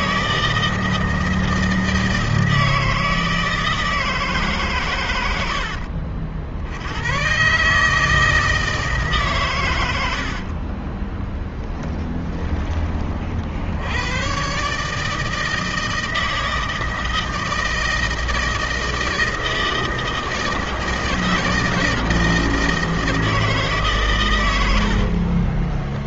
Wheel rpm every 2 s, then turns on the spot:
160, 160, 140, 60, 160, 60, 10, 120, 160, 160, 160, 160, 120.
10-12 24-26